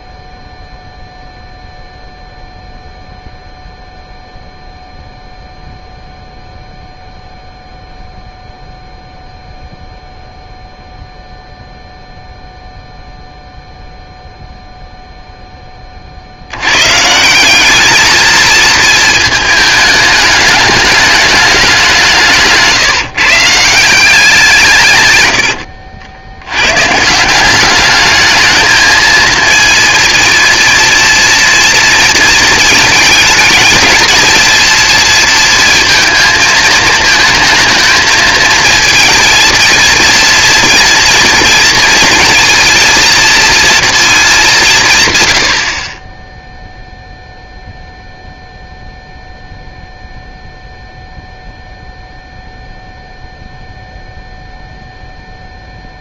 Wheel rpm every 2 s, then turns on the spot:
0, 0, 0, 0, 0, 0, 0, 0, 100, 220, 210, 160, 160, 110, 220, 230, 220, 230, 220, 220, 230, 230, 200, 0, 0, 0, 0, 0.
none